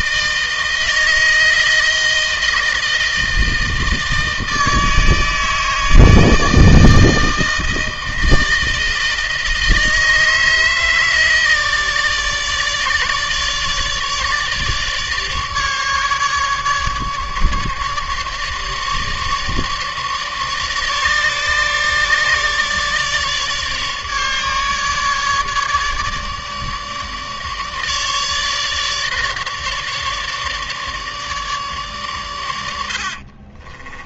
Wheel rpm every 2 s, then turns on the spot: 160, 160, 160, 160, 160, 160, 150, 150, 150, 150, 150, 150, 150, 150, 150, 150, 90.
32-34